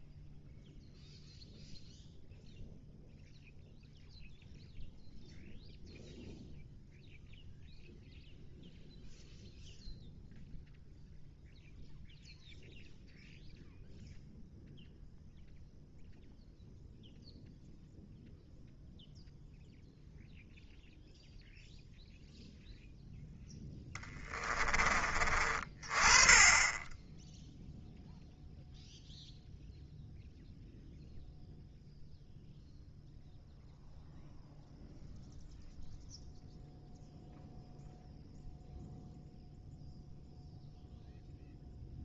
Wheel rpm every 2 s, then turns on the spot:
0, 0, 0, 0, 0, 0, 0, 0, 0, 0, 0, 0, 20, 10, 0, 0, 0, 0, 0, 0, 0.
none